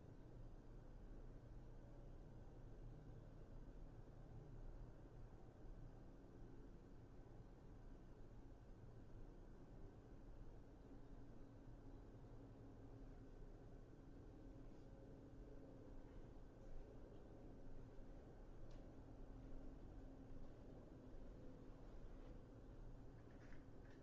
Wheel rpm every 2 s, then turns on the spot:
0, 0, 0, 0, 0, 0, 0, 0, 0, 0, 0, 0.
none